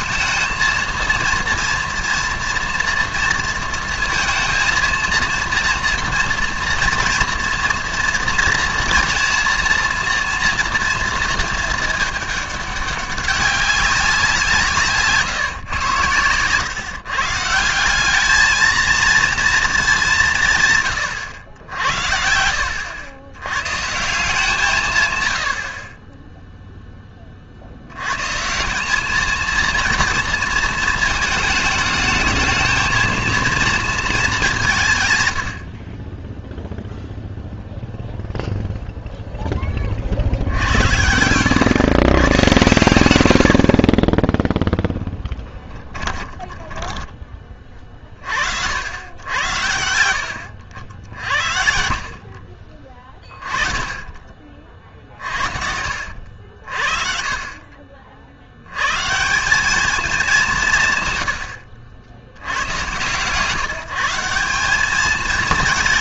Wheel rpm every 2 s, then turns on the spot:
220, 230, 230, 230, 230, 230, 200, 160, 120, 220, 150, 80, 160, 0, 160, 230, 220, 180, 0, 0, 80, 110, 0, 10, 80, 80, 40, 50, 50, 90, 160, 100, 190.
46-48